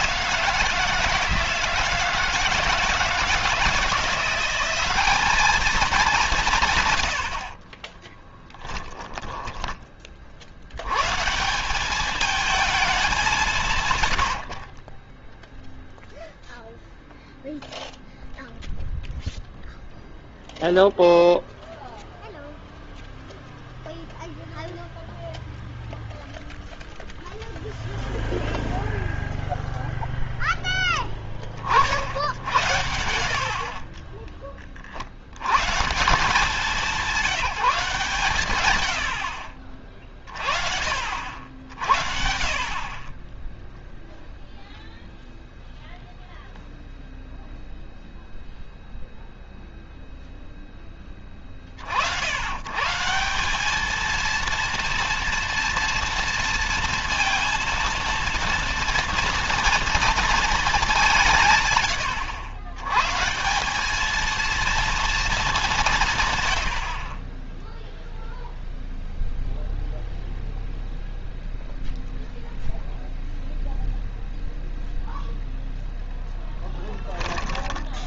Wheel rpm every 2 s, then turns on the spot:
160, 160, 190, 110, 10, 100, 210, 30, 0, 0, 0, 0, 0, 0, 0, 10, 80, 60, 180, 100, 50, 30, 0, 0, 0, 10, 140, 230, 230, 230, 190, 130, 230, 70, 0, 0, 0, 0, 10.
8-10